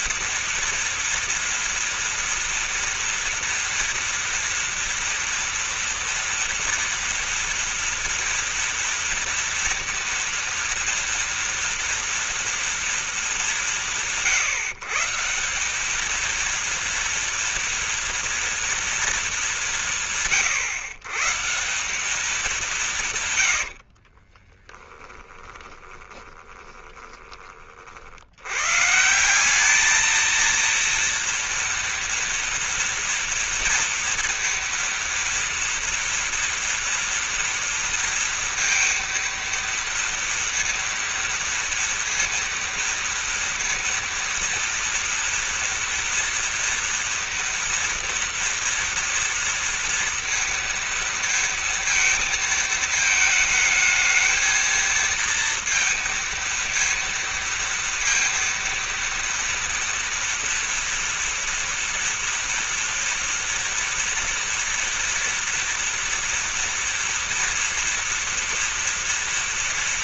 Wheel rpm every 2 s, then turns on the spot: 230, 230, 240, 230, 230, 230, 230, 150, 230, 230, 140, 170, 20, 20, 130, 230, 230, 230, 230, 230, 230, 230, 230, 230, 230, 230, 220, 220, 230, 230, 230, 230, 230, 240, 230.
24-28